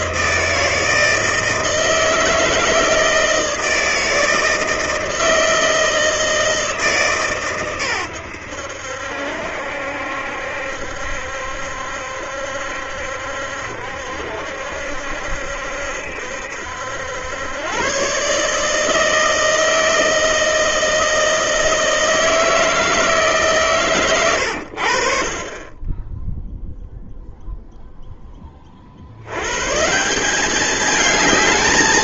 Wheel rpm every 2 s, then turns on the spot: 160, 160, 160, 160, 90, 70, 70, 70, 70, 150, 160, 160, 100, 0, 20, 200.
none